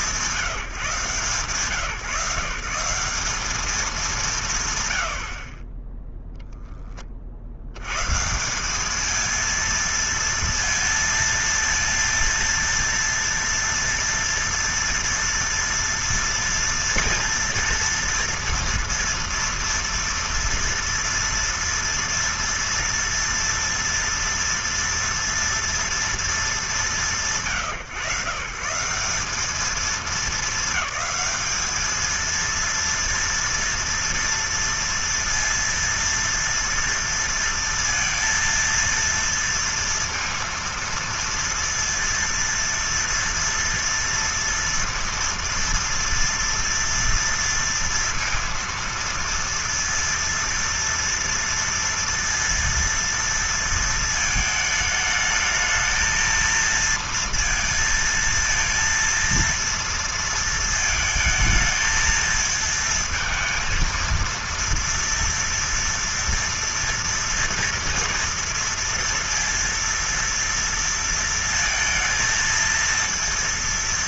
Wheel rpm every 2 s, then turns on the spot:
160, 170, 120, 10, 200, 230, 230, 230, 230, 230, 230, 230, 230, 180, 160, 200, 230, 230, 230, 230, 230, 230, 230, 230, 230, 230, 230, 220, 230, 230, 220, 230, 230, 230, 230, 230, 230.
none